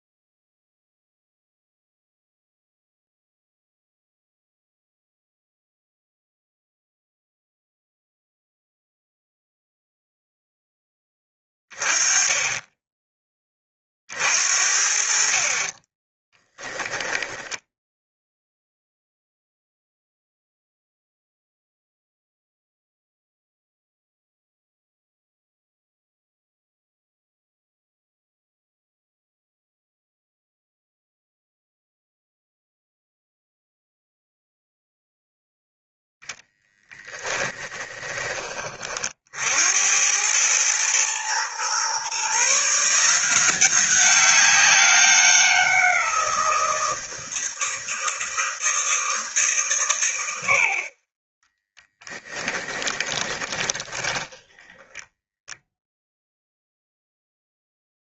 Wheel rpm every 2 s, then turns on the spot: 0, 0, 0, 0, 0, 10, 10, 60, 10, 0, 0, 0, 0, 0, 0, 0, 0, 0, 10, 40, 110, 160, 190, 170, 160, 50, 20, 10, 0.
16-18 52-56